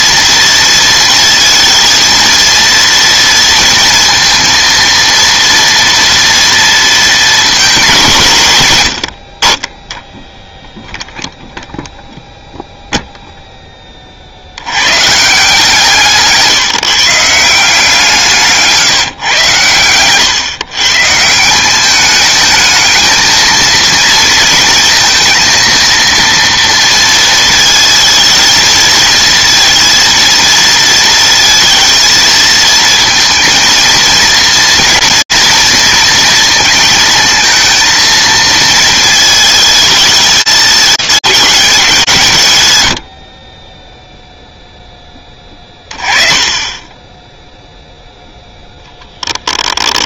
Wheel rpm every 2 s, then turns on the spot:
230, 230, 230, 230, 110, 0, 0, 90, 150, 160, 130, 220, 230, 230, 220, 230, 230, 230, 230, 220, 210, 120, 0, 20, 10.
18-20 48-50